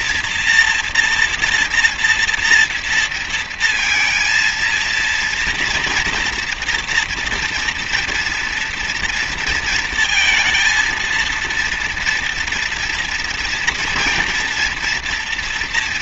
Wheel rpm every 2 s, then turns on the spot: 230, 230, 230, 240, 230, 220, 230, 230.
none